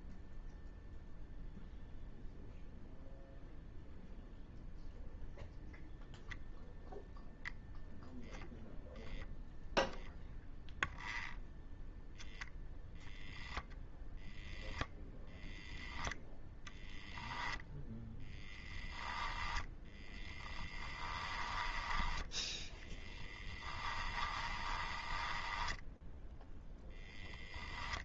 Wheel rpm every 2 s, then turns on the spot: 0, 0, 0, 0, 0, 0, 0, 0, 0, 10, 20, 20, 20, 0.
18-26